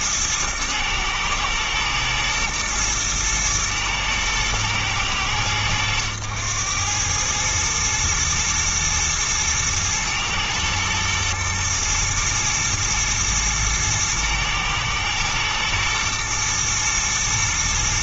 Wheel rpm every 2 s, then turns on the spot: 110, 110, 110, 100, 110, 110, 110, 110, 120.
none